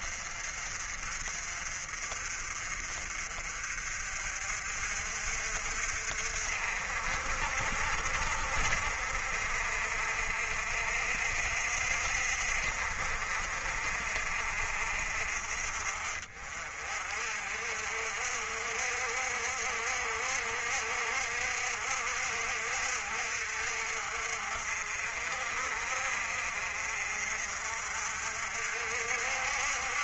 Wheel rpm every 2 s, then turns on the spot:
40, 40, 50, 60, 60, 60, 60, 50, 40, 60, 60, 60, 50, 50, 60.
none